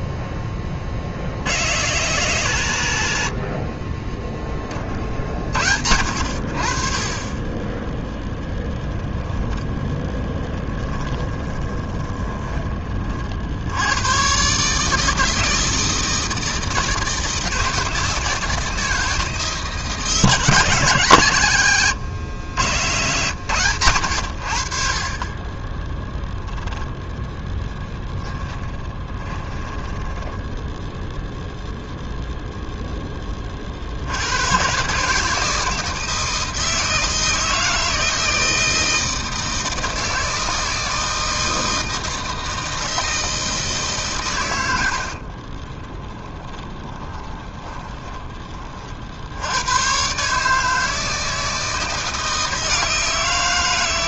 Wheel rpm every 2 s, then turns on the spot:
20, 140, 30, 50, 0, 10, 30, 140, 160, 160, 160, 110, 60, 10, 10, 10, 0, 130, 160, 160, 160, 160, 100, 20, 30, 150, 170.
10-12 22-24 28-30 46-48